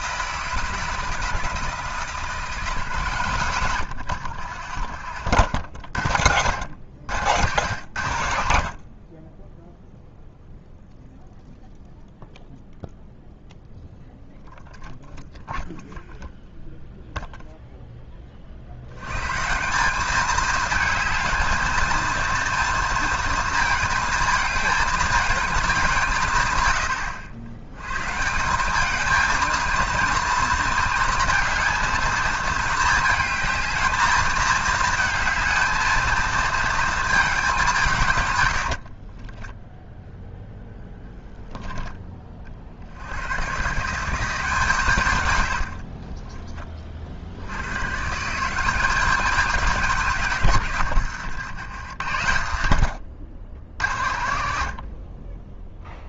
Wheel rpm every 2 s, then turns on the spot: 160, 170, 90, 90, 70, 0, 0, 0, 0, 60, 220, 230, 220, 100, 190, 230, 220, 220, 220, 80, 0, 50, 160, 20, 180, 140, 90, 60.
4-6 38-40 50-52